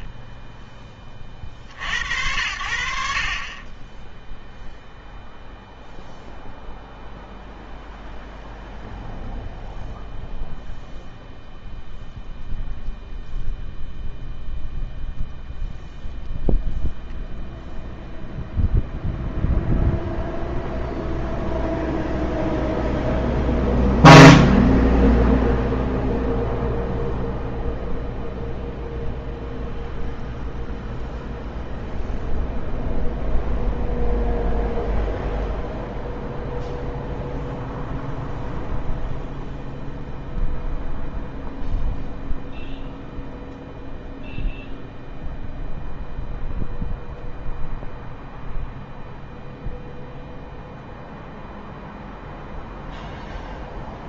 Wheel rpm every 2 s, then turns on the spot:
20, 70, 0, 0, 0, 0, 0, 0, 0, 0, 0, 0, 0, 0, 0, 0, 0, 0, 0, 0, 0, 0, 0, 0, 0, 0, 0.
none